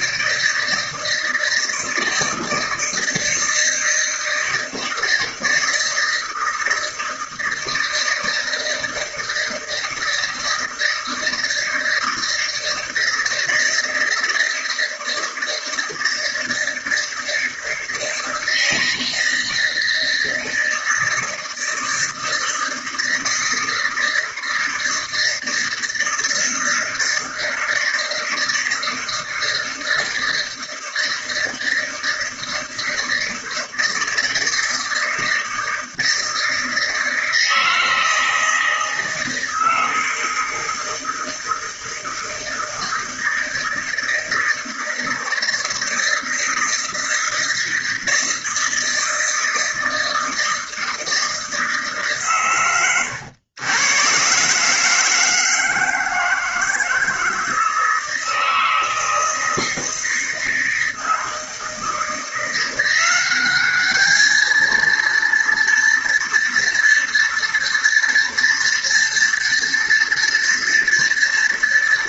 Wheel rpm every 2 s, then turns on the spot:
160, 160, 160, 160, 160, 160, 160, 160, 160, 160, 160, 160, 160, 160, 160, 160, 160, 160, 160, 160, 160, 160, 160, 160, 160, 160, 110, 150, 160, 160, 160, 180, 230, 230, 230, 230.
none